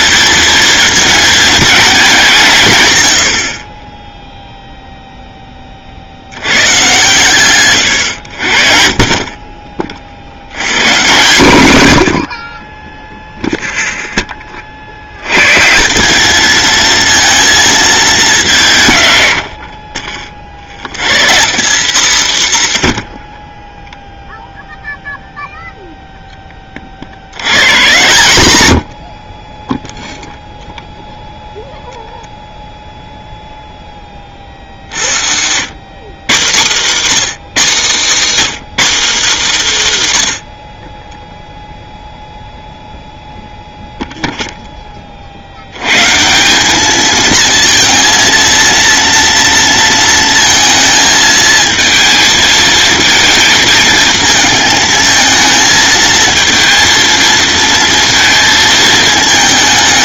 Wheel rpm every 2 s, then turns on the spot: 220, 120, 0, 120, 60, 130, 20, 60, 220, 150, 90, 110, 0, 30, 90, 0, 0, 60, 180, 270, 40, 0, 10, 200, 230, 220, 220, 220, 230, 220.
8-10